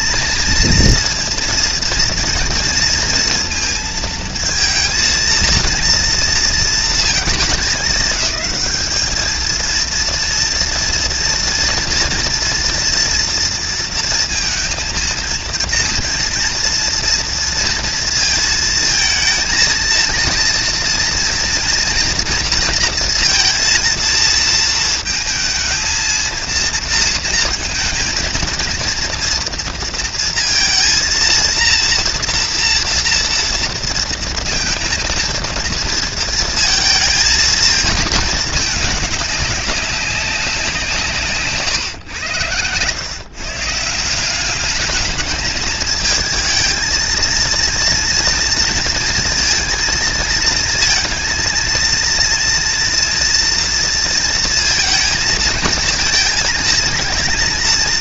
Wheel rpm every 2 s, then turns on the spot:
230, 230, 230, 230, 210, 230, 230, 230, 240, 230, 230, 230, 220, 230, 230, 230, 230, 230, 230, 210, 190, 110, 200, 220, 230, 230, 230, 230, 220.
none